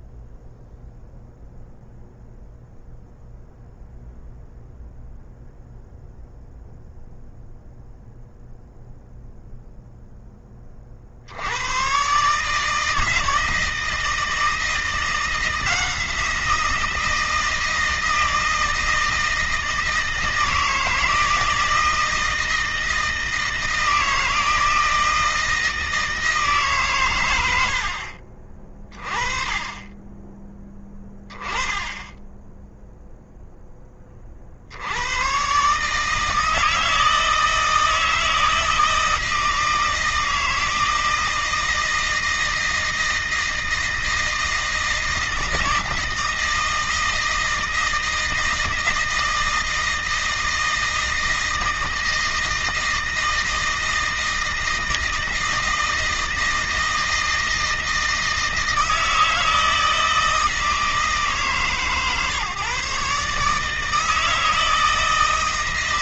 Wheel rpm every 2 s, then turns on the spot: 0, 0, 0, 0, 0, 40, 160, 160, 170, 160, 160, 160, 160, 120, 20, 10, 0, 100, 160, 160, 160, 160, 160, 160, 160, 160, 160, 160, 160, 160, 160, 150, 160.
none